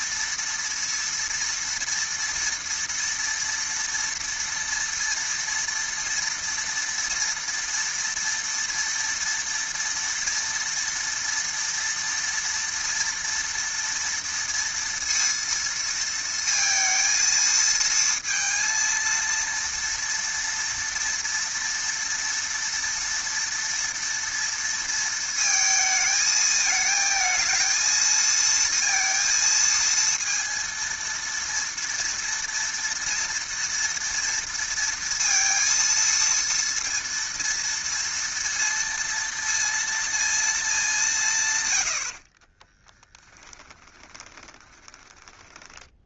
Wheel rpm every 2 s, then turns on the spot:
230, 230, 230, 230, 230, 230, 230, 230, 230, 230, 230, 230, 230, 220, 230, 230, 240, 230, 230, 230, 230, 40, 20.
42-46